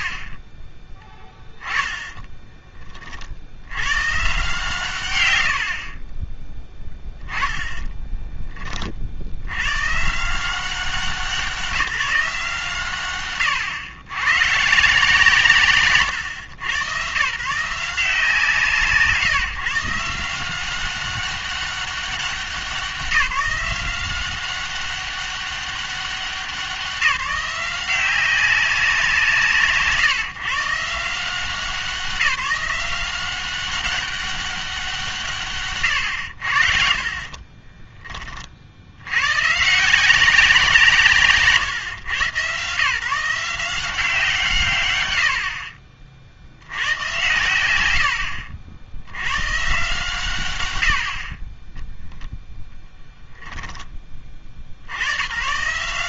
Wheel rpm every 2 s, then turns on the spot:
30, 20, 120, 10, 30, 180, 150, 130, 100, 160, 180, 190, 190, 190, 190, 160, 180, 200, 60, 60, 170, 140, 140, 100, 70, 100, 0, 60.
none